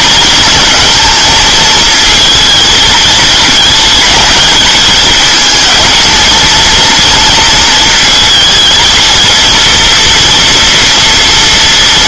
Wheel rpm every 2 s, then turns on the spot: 230, 220, 220, 230, 220, 230.
none